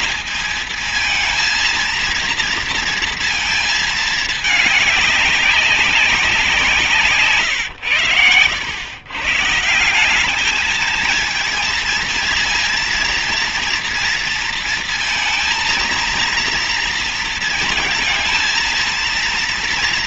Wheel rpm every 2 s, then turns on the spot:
220, 230, 200, 150, 120, 220, 230, 230, 230, 230.
none